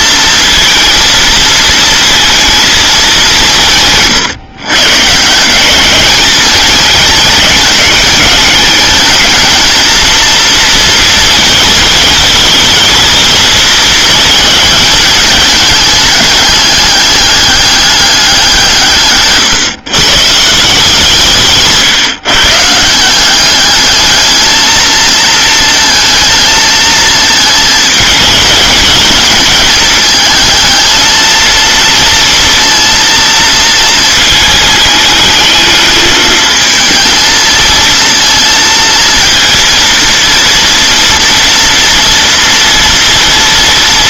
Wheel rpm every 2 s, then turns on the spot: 230, 220, 140, 220, 220, 230, 220, 220, 210, 150, 160, 170, 220, 220, 220, 220, 230, 220, 220, 230, 230, 230.
none